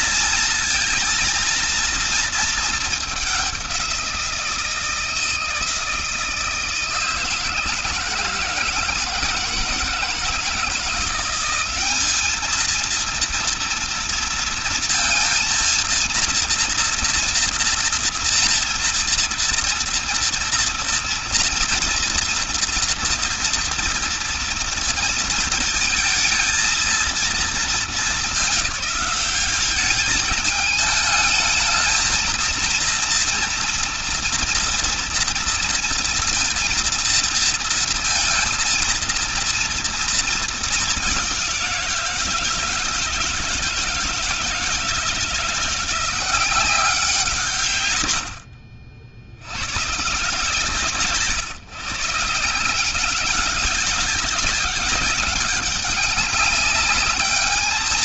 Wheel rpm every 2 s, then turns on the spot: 230, 210, 160, 160, 160, 170, 230, 230, 230, 230, 230, 230, 230, 230, 200, 220, 230, 230, 230, 230, 210, 160, 160, 180, 70, 160, 170, 190, 200.
none